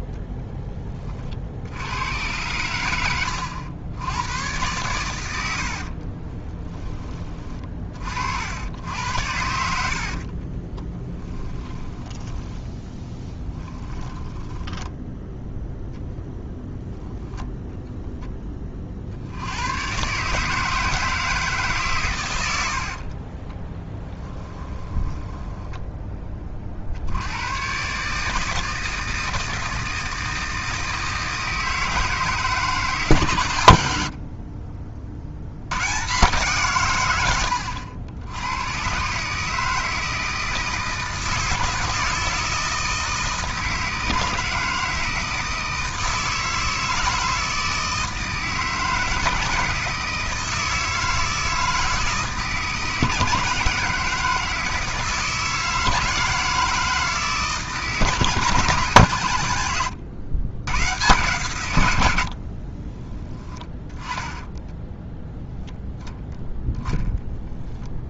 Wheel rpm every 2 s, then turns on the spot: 40, 100, 100, 20, 80, 10, 10, 10, 0, 50, 160, 50, 20, 70, 160, 160, 150, 40, 120, 120, 160, 160, 160, 160, 160, 160, 160, 160, 160, 130, 120, 20, 10, 0.
10-14 22-26 62-64